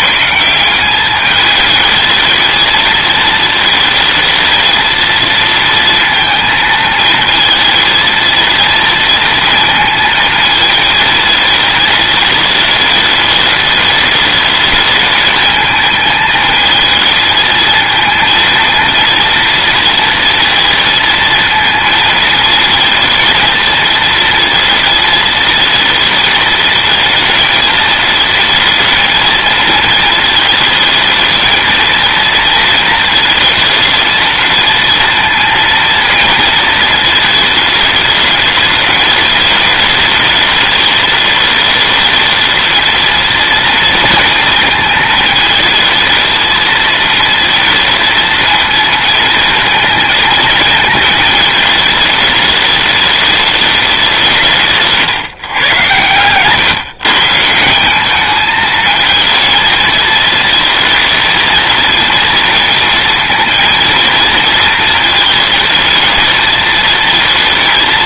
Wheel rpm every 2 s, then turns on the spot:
190, 220, 230, 220, 230, 220, 210, 220, 220, 230, 230, 230, 230, 220, 230, 220, 230, 230, 220, 210, 210, 230, 220, 230, 230, 220, 210, 170, 140, 220, 230, 230, 230, 220.
none